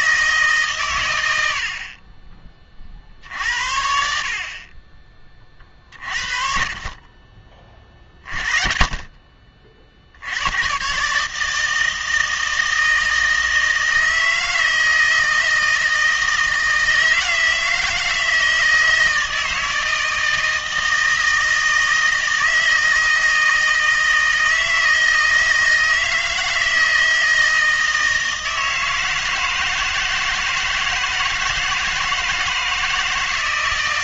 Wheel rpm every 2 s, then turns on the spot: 140, 40, 30, 40, 40, 120, 160, 160, 160, 160, 160, 160, 160, 160, 160, 160, 160.
none